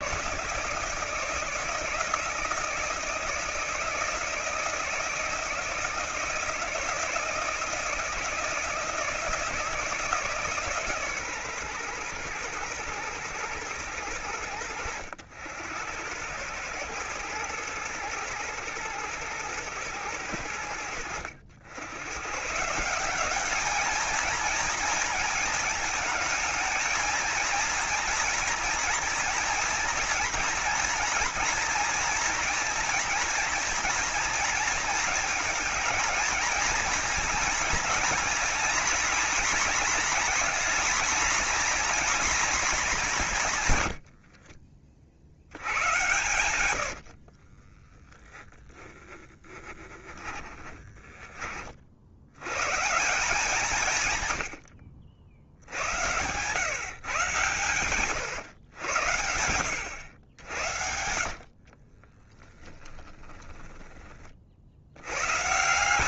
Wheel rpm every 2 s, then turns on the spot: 160, 160, 160, 160, 160, 140, 120, 80, 110, 120, 90, 190, 230, 230, 240, 230, 230, 230, 230, 240, 240, 170, 60, 60, 10, 20, 170, 70, 140, 90, 70, 10, 110.
46-48 60-64